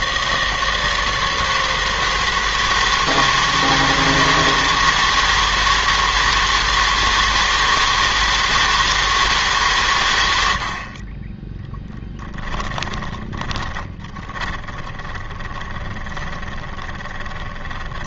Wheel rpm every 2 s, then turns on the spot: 160, 160, 160, 160, 160, 70, 10, 20, 20.
12-18